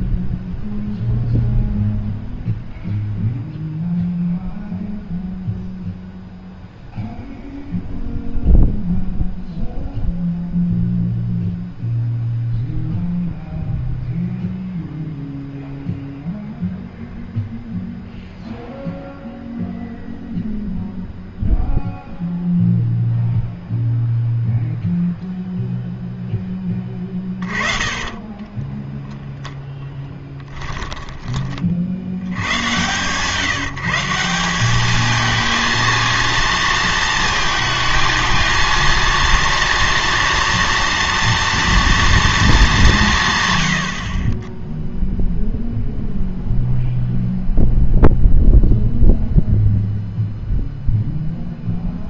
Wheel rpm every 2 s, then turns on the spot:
0, 0, 0, 0, 0, 0, 0, 0, 0, 0, 0, 0, 0, 10, 10, 10, 100, 200, 230, 230, 230, 200, 10, 0, 0, 0.
28-32